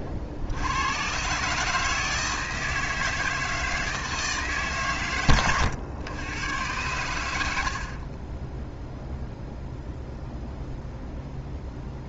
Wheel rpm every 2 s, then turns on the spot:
90, 160, 130, 100, 0, 0.
none